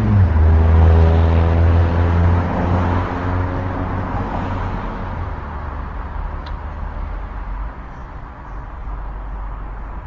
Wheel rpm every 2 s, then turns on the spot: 0, 0, 0, 0, 0.
none